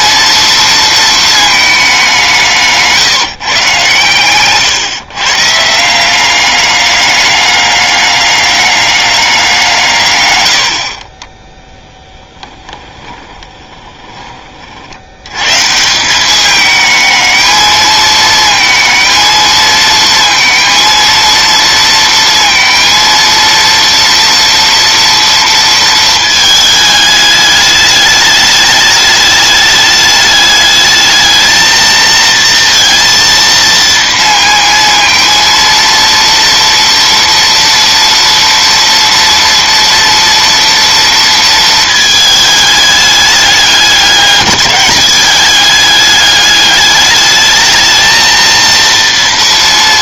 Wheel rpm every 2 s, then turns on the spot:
230, 170, 130, 200, 200, 90, 10, 50, 210, 220, 230, 230, 230, 220, 210, 210, 230, 230, 230, 230, 230, 210, 200, 210, 230.
12-14